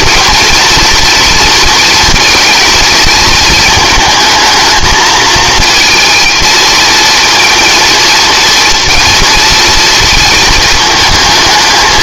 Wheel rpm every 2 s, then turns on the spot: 230, 220, 220, 230, 230, 220.
none